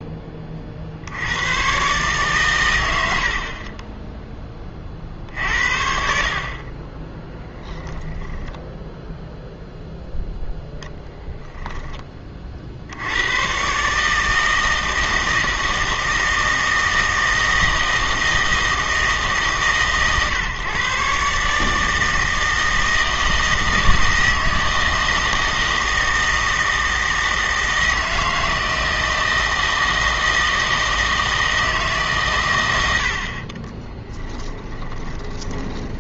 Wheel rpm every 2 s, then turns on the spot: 40, 100, 30, 40, 0, 20, 60, 160, 160, 160, 130, 160, 160, 160, 160, 160, 100, 30.
34-36